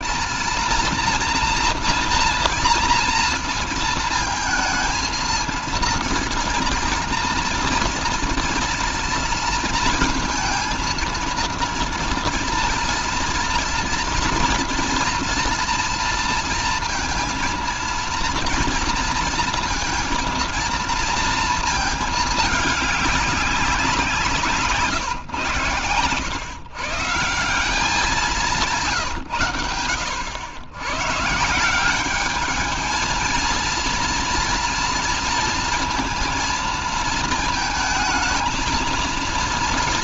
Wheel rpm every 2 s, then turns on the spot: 230, 230, 220, 230, 230, 230, 230, 240, 230, 230, 230, 210, 160, 160, 170, 110, 220, 230, 220, 220.
none